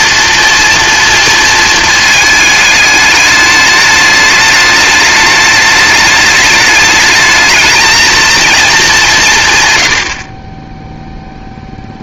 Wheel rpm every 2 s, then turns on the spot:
230, 210, 210, 210, 210, 10.
none